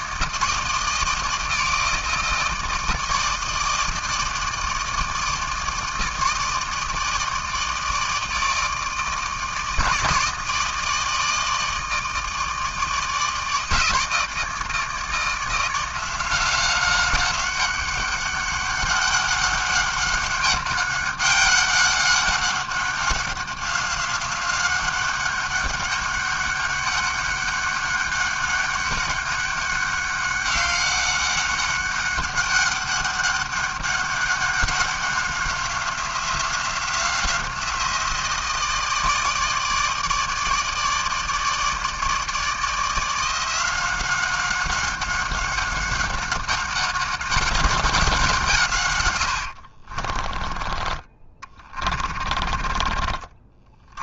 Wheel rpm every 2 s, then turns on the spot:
160, 160, 160, 160, 160, 160, 160, 160, 190, 200, 200, 190, 200, 200, 200, 190, 200, 190, 180, 160, 160, 170, 190, 200, 90, 30, 50.
48-52